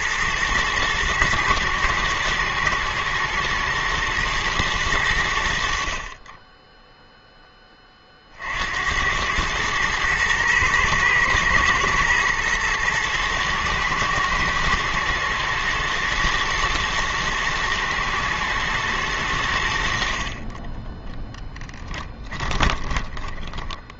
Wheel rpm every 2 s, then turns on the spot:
110, 120, 110, 10, 60, 110, 110, 120, 110, 110, 20, 20.
22-24